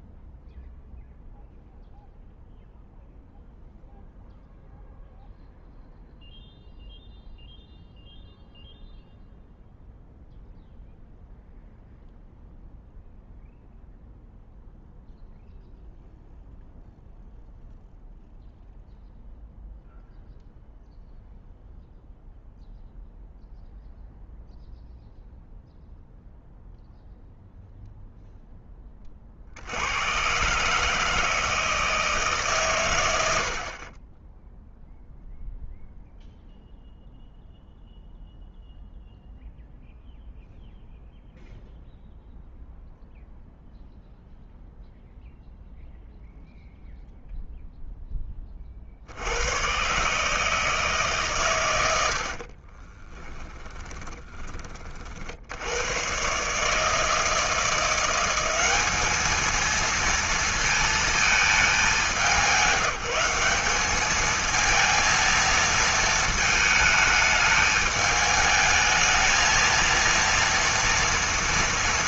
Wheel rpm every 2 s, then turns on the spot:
0, 0, 0, 0, 0, 0, 0, 0, 0, 0, 0, 0, 0, 0, 10, 130, 130, 10, 0, 0, 0, 0, 0, 0, 30, 160, 50, 30, 140, 190, 230, 190, 220, 220, 220, 230.
52-54